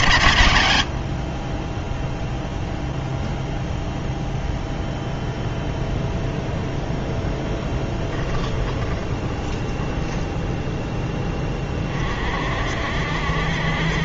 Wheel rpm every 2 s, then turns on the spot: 90, 0, 0, 0, 10, 0, 50.
8-10